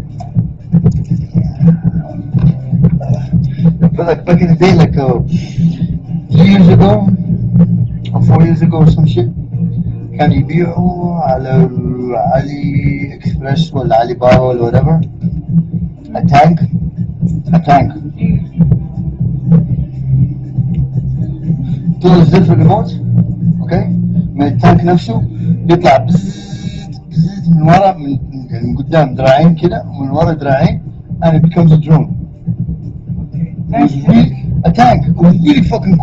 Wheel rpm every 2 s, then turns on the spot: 0, 0, 0, 0, 0, 0, 0, 0, 0, 0, 0, 0, 0, 0, 0, 0, 0, 0.
none